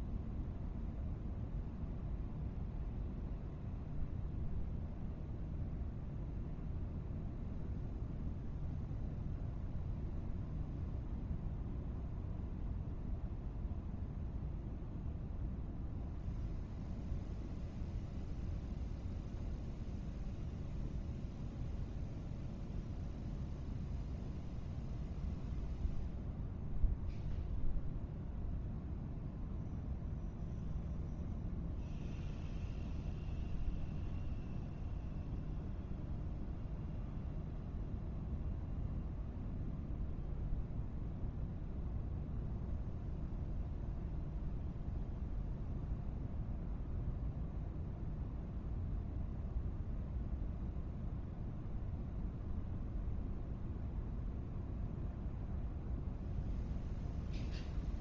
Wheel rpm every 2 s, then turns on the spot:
0, 0, 0, 0, 0, 0, 0, 0, 0, 0, 0, 0, 0, 0, 0, 0, 0, 0, 0, 0, 0, 0, 0, 0, 0, 0, 0, 0, 0.
none